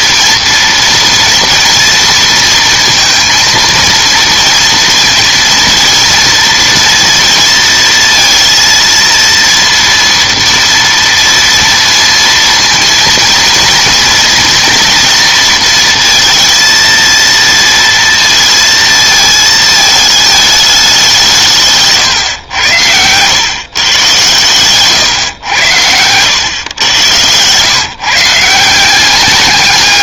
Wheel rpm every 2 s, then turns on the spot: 230, 230, 230, 230, 230, 240, 230, 230, 230, 230, 210, 110, 110, 110, 160.
none